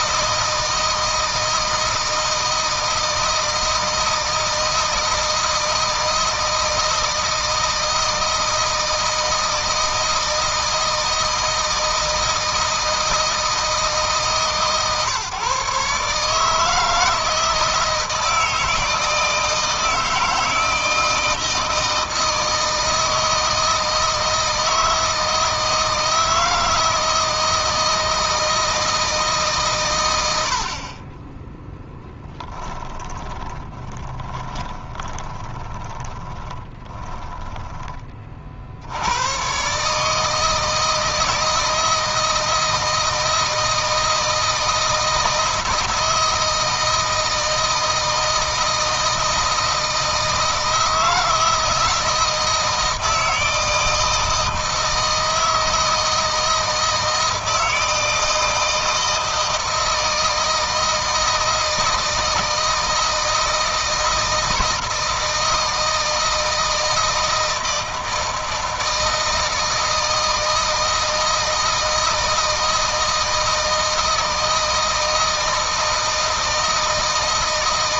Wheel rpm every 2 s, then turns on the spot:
160, 160, 160, 160, 160, 160, 160, 130, 150, 160, 160, 160, 160, 160, 160, 60, 10, 10, 20, 90, 160, 160, 160, 160, 160, 160, 160, 160, 160, 160, 160, 160, 160, 160, 160, 160, 160, 160, 160.
32-38